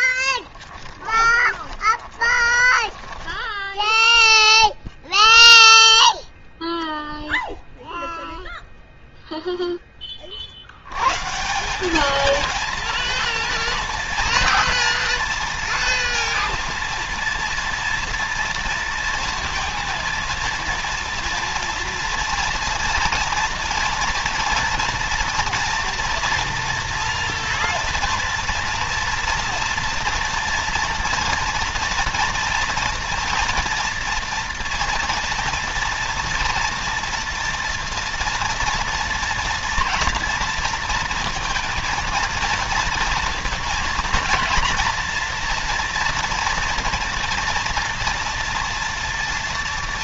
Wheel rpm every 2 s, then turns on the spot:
10, 20, 0, 0, 0, 40, 210, 230, 230, 230, 230, 230, 230, 230, 230, 240, 230, 240, 230, 230, 230, 230, 240, 230, 230.
0-4